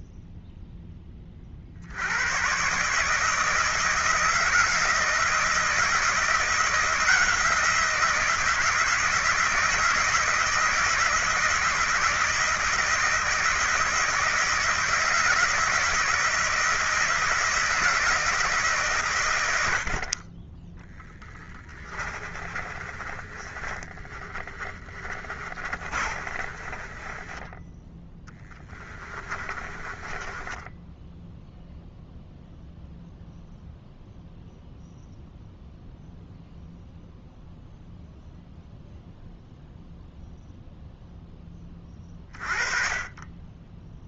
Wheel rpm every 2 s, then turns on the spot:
10, 140, 170, 170, 160, 170, 160, 160, 160, 130, 10, 30, 20, 20, 20, 10, 0, 0, 0, 0, 0, 30.
20-32